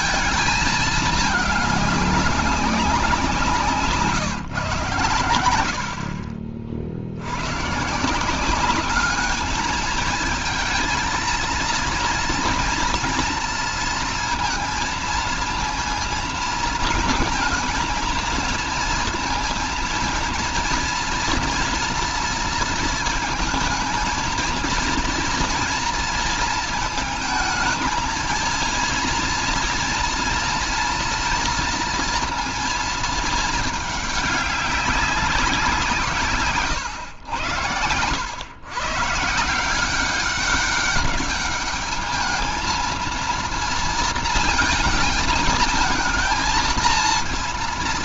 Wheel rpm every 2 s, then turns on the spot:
210, 180, 110, 80, 210, 230, 230, 230, 220, 230, 230, 230, 230, 220, 230, 230, 230, 200, 110, 130, 200, 220, 220, 230.
none